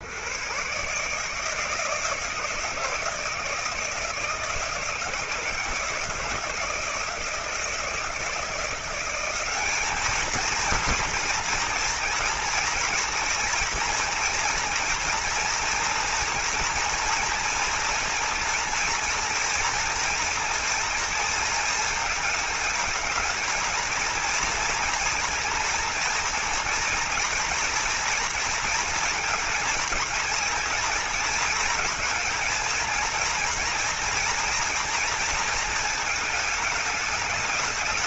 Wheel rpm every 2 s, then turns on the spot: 160, 160, 160, 160, 200, 230, 240, 240, 230, 230, 230, 230, 230, 240, 230, 230, 230, 230, 210.
none